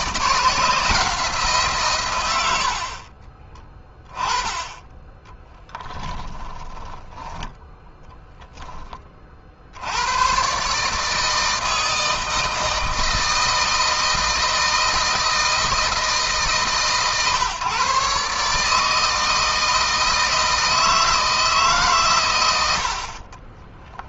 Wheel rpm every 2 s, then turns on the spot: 160, 60, 10, 10, 20, 150, 160, 160, 140, 160, 160, 70.
6-8